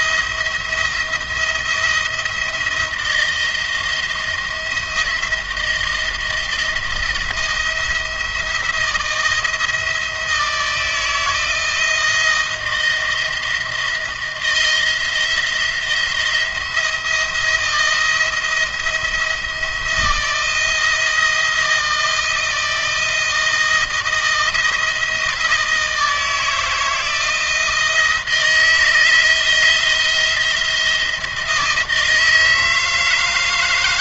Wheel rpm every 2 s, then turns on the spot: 160, 170, 170, 170, 170, 160, 170, 160, 170, 170, 170, 160, 170, 160, 160, 170, 160.
none